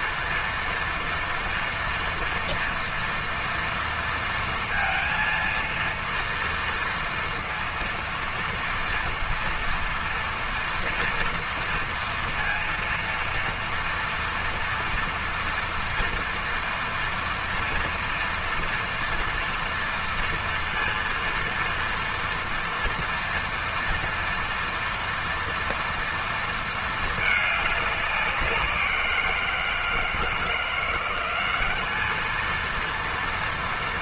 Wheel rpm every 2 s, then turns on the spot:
230, 230, 230, 230, 240, 230, 230, 230, 230, 230, 230, 230, 230, 220, 180, 180, 230.
none